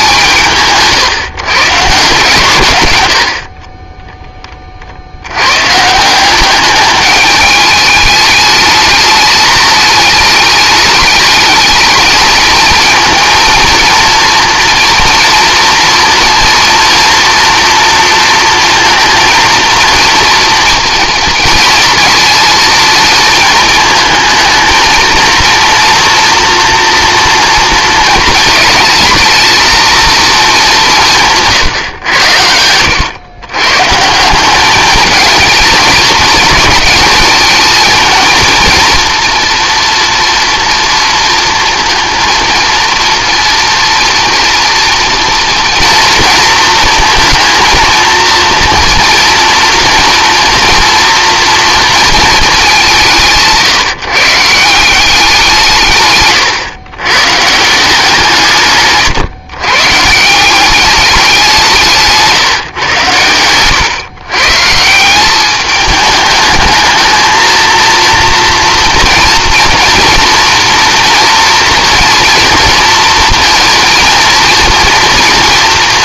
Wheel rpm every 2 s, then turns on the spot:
150, 120, 40, 200, 210, 210, 220, 230, 230, 230, 230, 230, 220, 230, 220, 220, 90, 200, 210, 220, 230, 230, 230, 230, 240, 230, 200, 170, 120, 150, 190, 140, 150, 220, 240, 240, 230, 230.
none